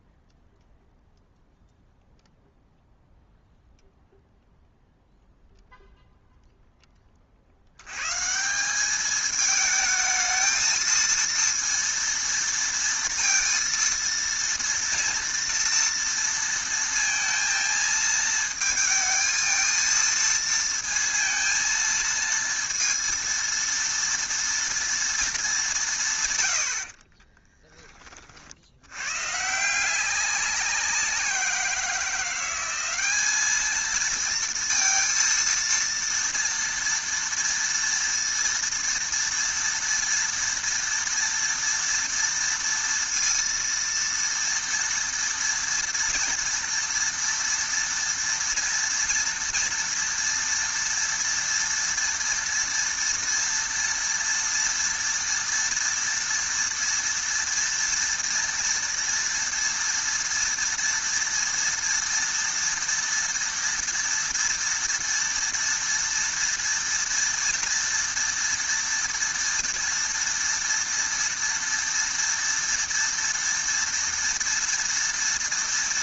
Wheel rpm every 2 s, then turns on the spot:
0, 0, 0, 0, 170, 220, 230, 230, 230, 220, 230, 230, 230, 100, 70, 190, 190, 230, 230, 230, 230, 230, 230, 230, 230, 230, 230, 230, 230, 230, 230, 230, 230, 230, 230, 230, 230, 230.
none